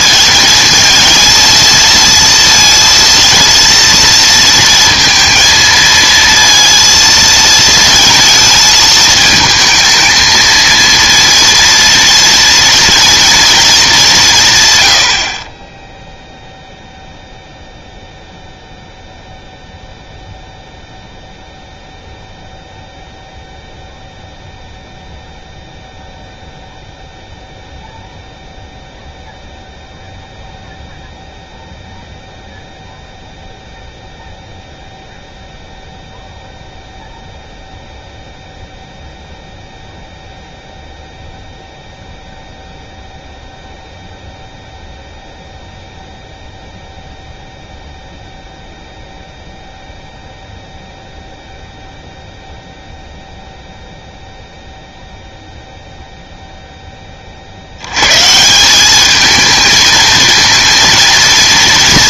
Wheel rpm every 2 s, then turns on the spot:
220, 230, 230, 230, 220, 230, 230, 130, 0, 0, 0, 0, 0, 0, 0, 0, 0, 0, 0, 0, 0, 0, 0, 0, 0, 0, 0, 0, 0, 180, 230.
none